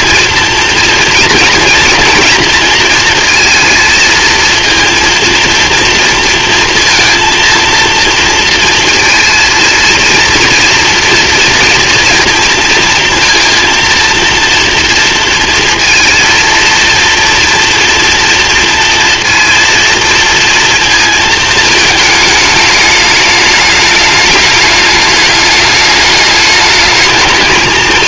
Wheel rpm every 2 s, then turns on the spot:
230, 230, 230, 230, 230, 230, 230, 230, 230, 230, 230, 220, 210, 210.
none